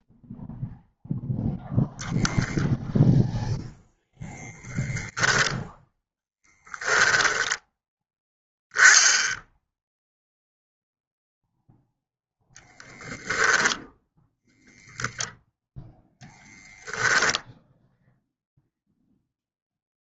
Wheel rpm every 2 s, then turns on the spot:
0, 0, 10, 10, 0, 0, 0, 0, 0, 0.
6-8